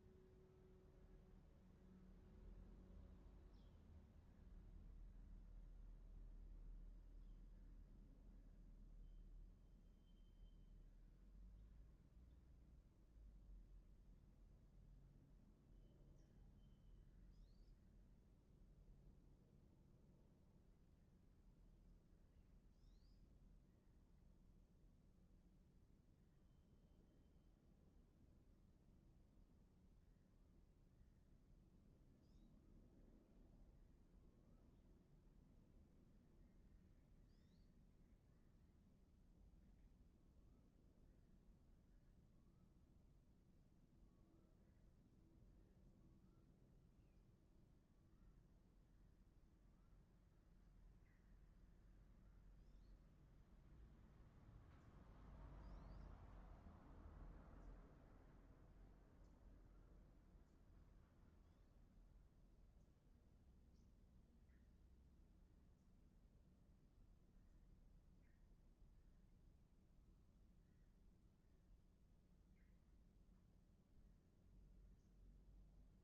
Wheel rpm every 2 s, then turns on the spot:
0, 0, 0, 0, 0, 0, 0, 0, 0, 0, 0, 0, 0, 0, 0, 0, 0, 0, 0, 0, 0, 0, 0, 0, 0, 0, 0, 0, 0, 0, 0, 0, 0, 0, 0, 0, 0, 0.
none